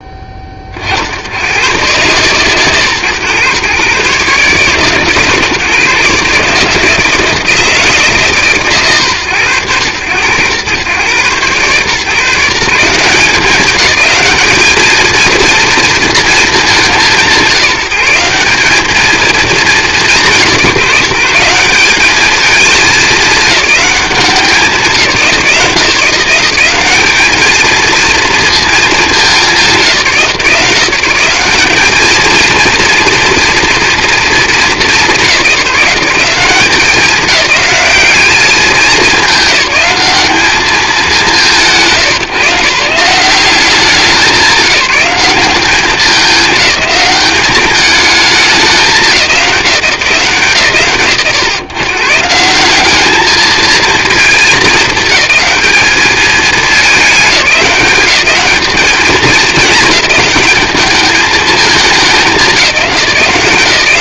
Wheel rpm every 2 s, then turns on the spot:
40, 120, 140, 160, 130, 110, 170, 220, 210, 200, 180, 210, 180, 180, 220, 160, 230, 200, 180, 210, 200, 150, 190, 210, 210, 130, 180, 220, 210, 200, 210, 190.
none